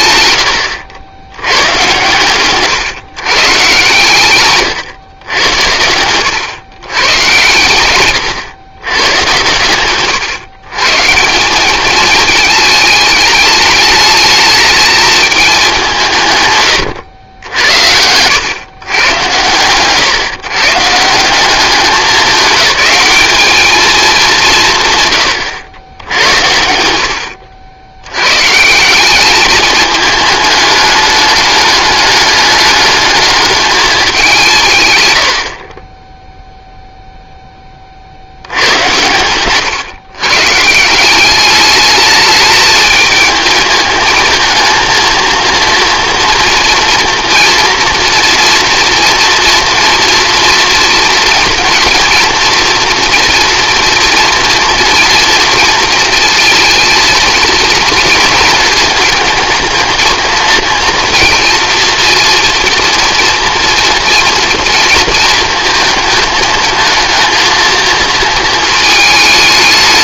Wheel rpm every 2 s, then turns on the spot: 90, 130, 120, 110, 110, 130, 210, 220, 110, 120, 140, 200, 160, 80, 150, 210, 210, 150, 0, 90, 160, 220, 220, 230, 230, 240, 230, 240, 230, 230, 230, 230, 230, 220, 220.
4-6